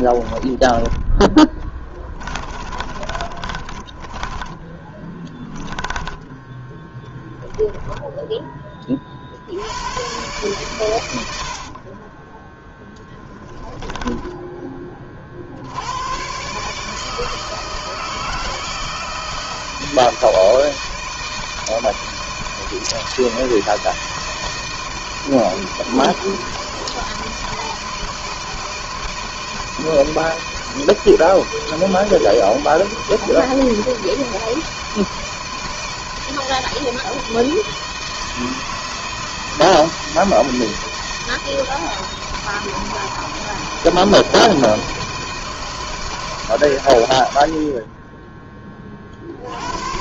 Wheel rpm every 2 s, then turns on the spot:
20, 30, 10, 10, 20, 110, 20, 20, 130, 160, 160, 160, 160, 160, 160, 160, 160, 160, 160, 160, 160, 160, 160, 130, 30.
0-6 12-14